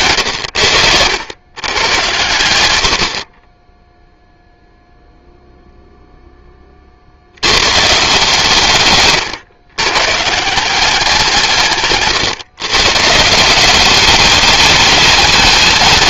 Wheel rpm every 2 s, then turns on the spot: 100, 90, 0, 10, 140, 160, 130, 210.
0-2